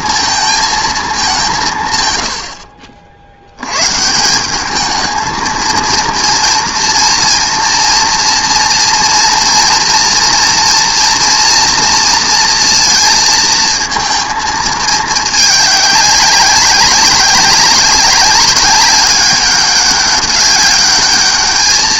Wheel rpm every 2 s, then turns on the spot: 230, 80, 190, 230, 230, 230, 230, 220, 200, 200, 200.
none